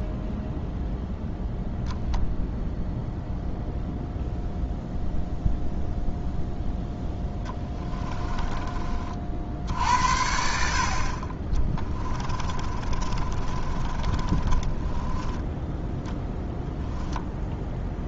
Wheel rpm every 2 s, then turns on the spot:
0, 0, 0, 0, 40, 30, 30, 20, 0.
12-16